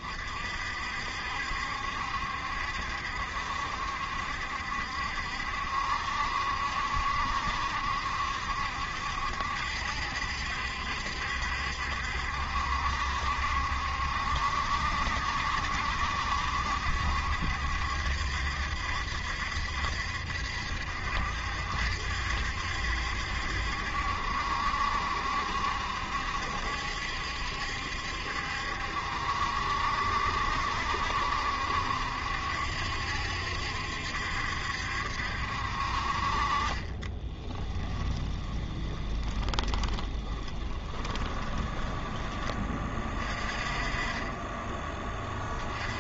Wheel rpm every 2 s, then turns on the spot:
60, 70, 70, 70, 70, 70, 70, 70, 70, 70, 70, 70, 70, 70, 70, 70, 70, 70, 30, 20, 20, 30, 20.
36-42